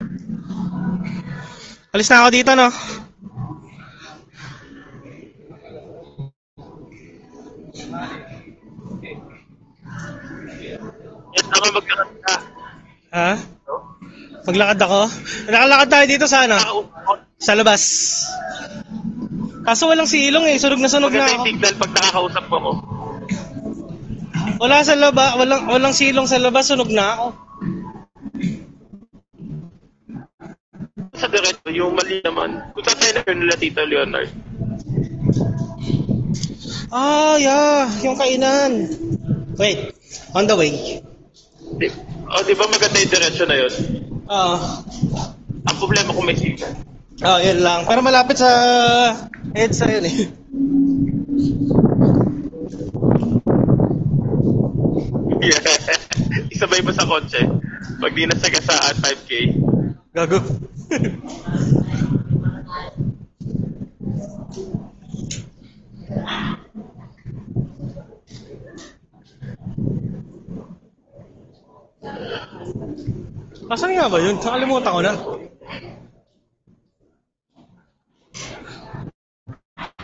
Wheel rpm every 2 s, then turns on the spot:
0, 0, 0, 0, 0, 0, 0, 0, 0, 0, 0, 0, 0, 0, 0, 0, 0, 0, 0, 0, 0, 0, 0, 0, 0, 0, 0, 0, 0, 0, 0, 0, 0, 0, 0, 0, 0, 0, 0, 0.
none